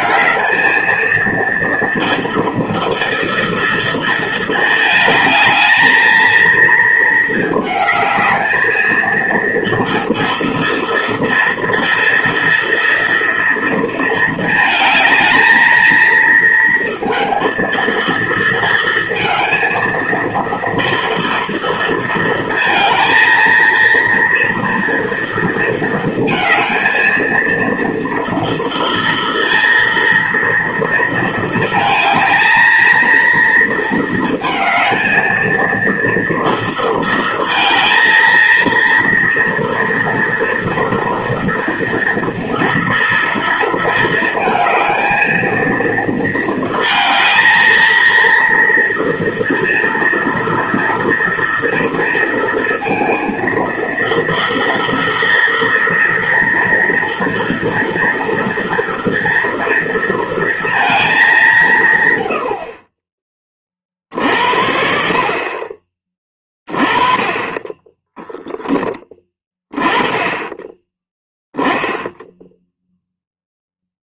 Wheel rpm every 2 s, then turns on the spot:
220, 230, 230, 220, 220, 240, 230, 230, 220, 230, 230, 230, 230, 230, 230, 230, 220, 230, 230, 230, 230, 230, 220, 230, 230, 230, 230, 230, 230, 230, 230, 100, 50, 20, 20, 20, 0.
68-70